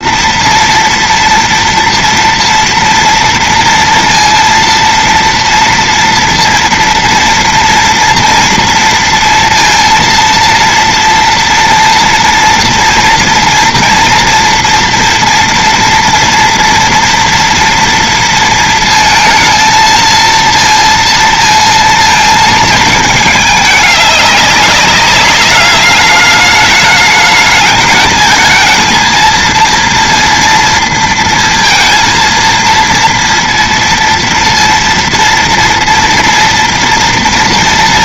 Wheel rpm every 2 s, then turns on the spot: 230, 230, 230, 230, 230, 230, 230, 230, 240, 230, 230, 220, 200, 210, 220, 230, 230, 230, 230.
none